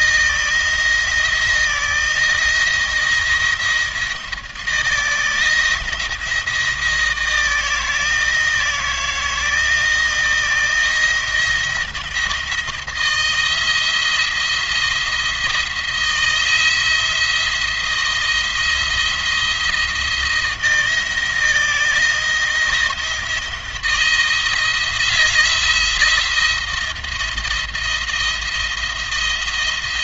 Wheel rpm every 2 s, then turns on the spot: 170, 170, 170, 160, 160, 170, 170, 170, 170, 170, 170, 170, 170, 170, 170.
none